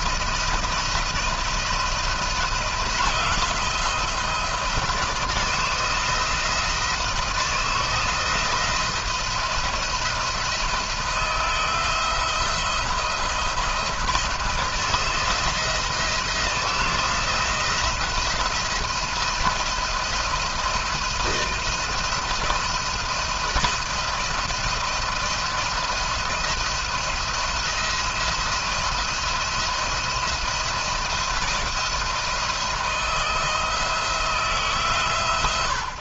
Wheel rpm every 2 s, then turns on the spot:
170, 170, 170, 160, 170, 160, 170, 160, 160, 170, 160, 170, 170, 170, 170, 160, 160, 150.
none